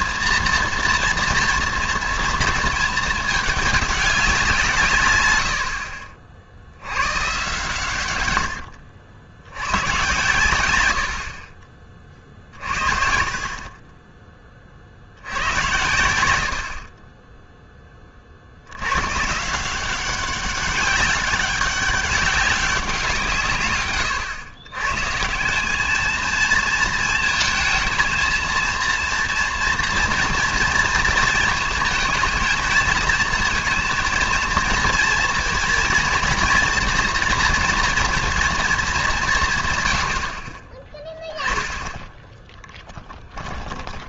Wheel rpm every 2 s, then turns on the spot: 230, 210, 120, 110, 70, 100, 40, 50, 50, 90, 200, 180, 120, 220, 230, 230, 220, 230, 230, 220, 20, 10.
none